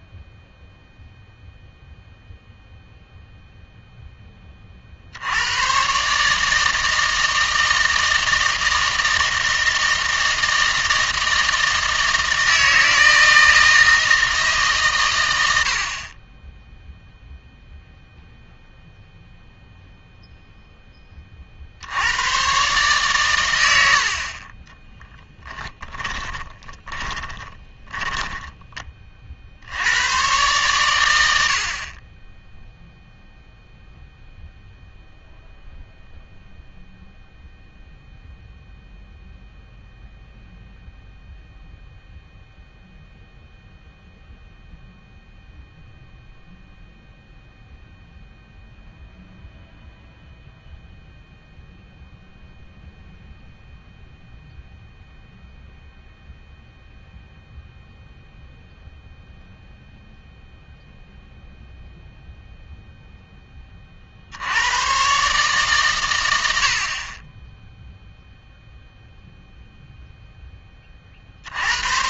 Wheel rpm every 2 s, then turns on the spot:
0, 0, 40, 160, 160, 160, 160, 140, 0, 0, 10, 140, 20, 20, 20, 120, 0, 0, 0, 0, 0, 0, 0, 0, 0, 0, 0, 0, 0, 0, 0, 0, 110, 60, 0, 20.
24-28